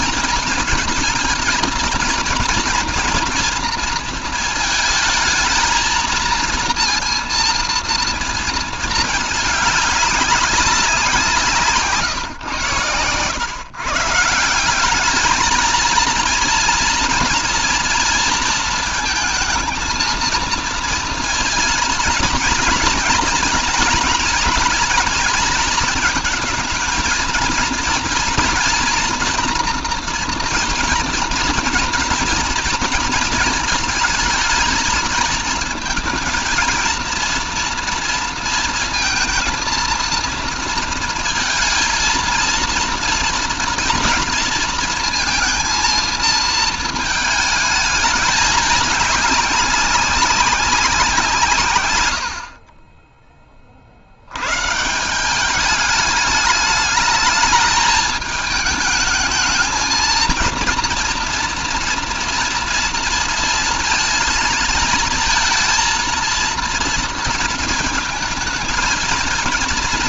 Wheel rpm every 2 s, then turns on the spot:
230, 230, 220, 230, 220, 190, 120, 190, 230, 220, 220, 230, 230, 220, 230, 230, 230, 220, 230, 230, 230, 230, 230, 220, 210, 180, 30, 160, 210, 220, 230, 230, 220, 230, 220.
none